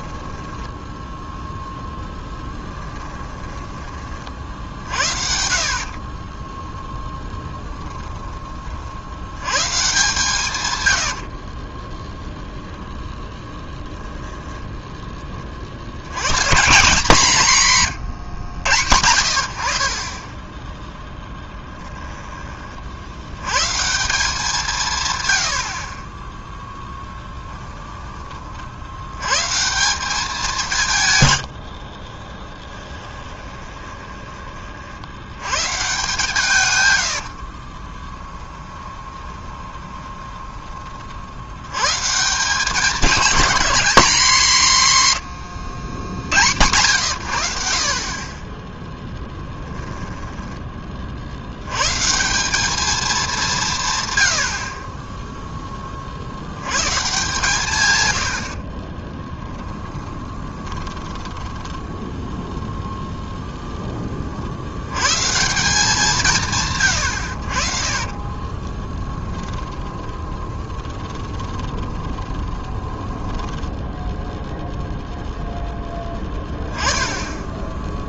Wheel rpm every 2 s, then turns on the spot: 10, 10, 60, 10, 40, 100, 10, 10, 170, 90, 10, 50, 150, 0, 60, 170, 10, 50, 110, 20, 30, 190, 180, 110, 10, 30, 210, 40, 110, 40, 20, 0, 100, 130, 20, 20, 10, 0, 10.
0-4 6-8 10-12 32-34 36-40 58-62 68-74